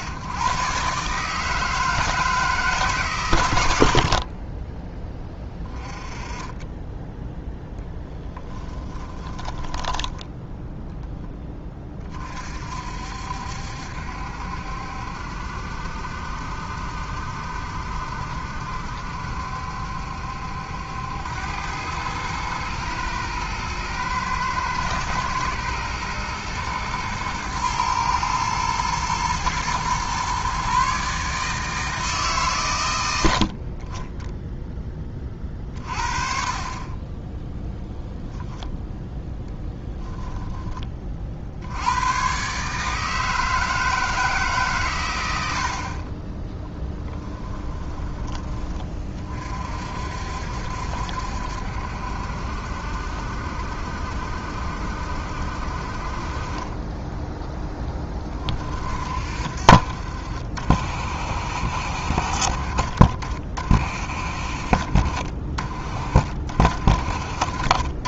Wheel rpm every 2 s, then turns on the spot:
100, 150, 30, 20, 10, 10, 60, 70, 70, 70, 80, 110, 110, 120, 110, 140, 110, 10, 20, 0, 20, 140, 120, 10, 20, 60, 70, 70, 20, 40, 50, 40, 50, 40.
8-10 46-48